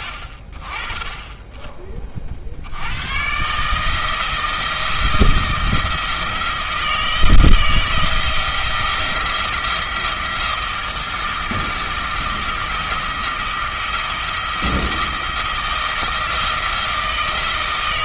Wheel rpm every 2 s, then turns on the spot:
20, 80, 160, 160, 170, 170, 170, 160, 170.
none